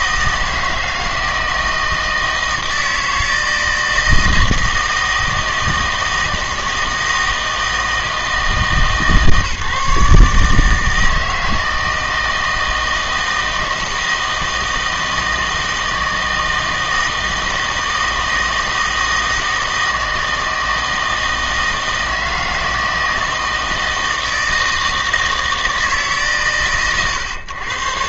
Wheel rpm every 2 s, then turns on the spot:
160, 160, 160, 160, 150, 160, 160, 160, 160, 160, 160, 160, 160, 130.
none